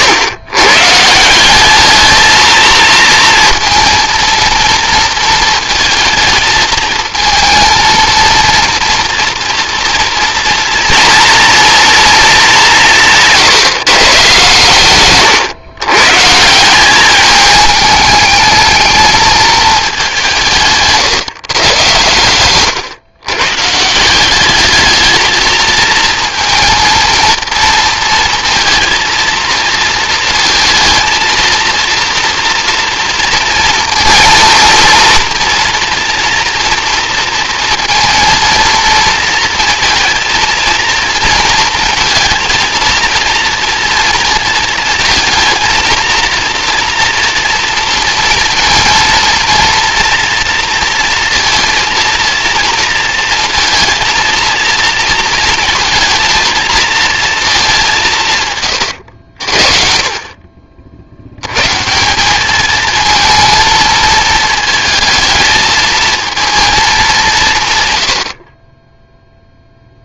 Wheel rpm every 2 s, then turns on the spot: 140, 230, 230, 220, 230, 230, 190, 120, 190, 210, 150, 120, 210, 230, 230, 230, 240, 230, 230, 230, 230, 230, 220, 230, 230, 230, 230, 230, 230, 120, 50, 220, 220, 220, 30.
20-22